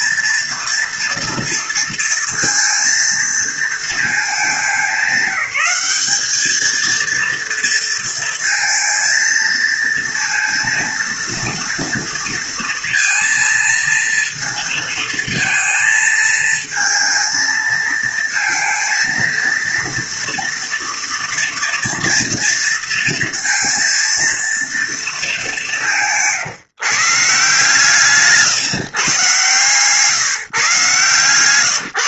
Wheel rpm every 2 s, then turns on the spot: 230, 230, 200, 220, 230, 230, 230, 230, 220, 230, 230, 230, 230, 160, 140, 140.
none